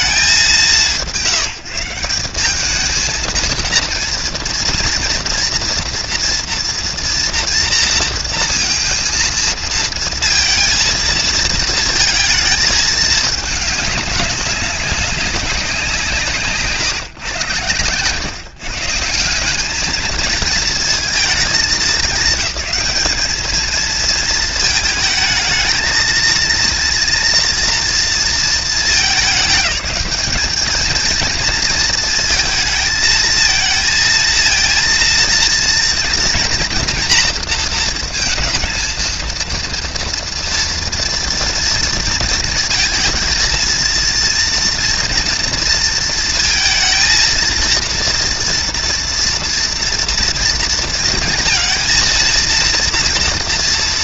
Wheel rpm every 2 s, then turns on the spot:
160, 210, 230, 230, 230, 230, 220, 190, 130, 160, 220, 220, 220, 230, 210, 230, 220, 230, 230, 230, 230, 230, 240, 230, 230, 230, 230.
none